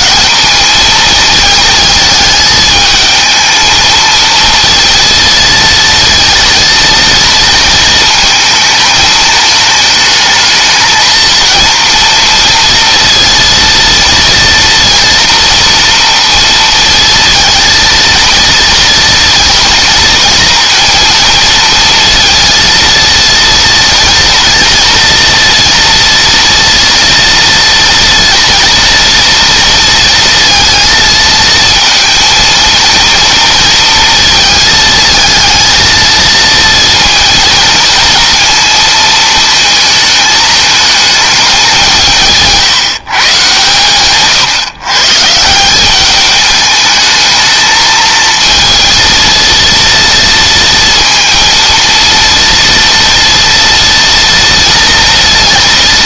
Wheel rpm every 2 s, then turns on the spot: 220, 220, 230, 230, 220, 220, 230, 230, 230, 230, 230, 230, 230, 230, 230, 230, 230, 220, 230, 220, 220, 140, 130, 210, 230, 230, 240, 230.
none